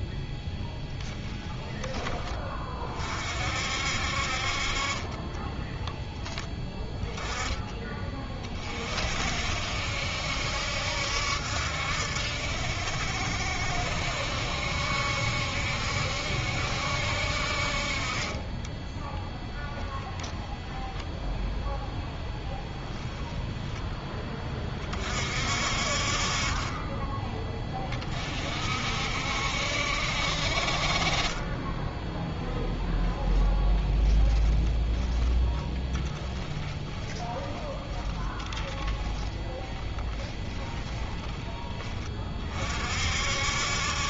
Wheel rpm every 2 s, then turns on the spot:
0, 30, 30, 10, 40, 70, 70, 70, 70, 10, 0, 0, 30, 30, 60, 50, 0, 20, 10, 10, 10, 50.
34-42